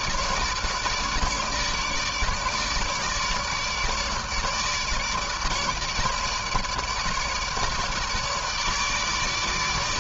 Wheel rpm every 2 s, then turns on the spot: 160, 150, 150, 150, 150.
none